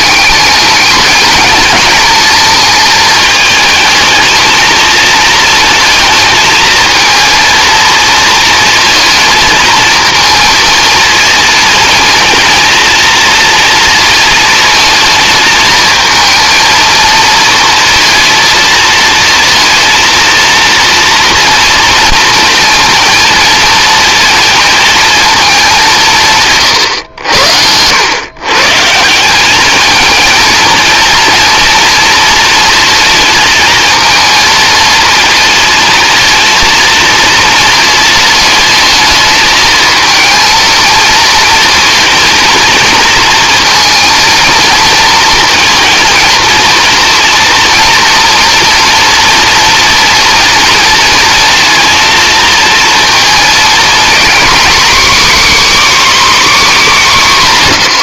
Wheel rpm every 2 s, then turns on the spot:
200, 220, 230, 220, 230, 230, 230, 230, 230, 230, 230, 230, 220, 140, 150, 230, 230, 220, 230, 220, 230, 230, 230, 230, 230, 230, 230, 270, 250.
26-28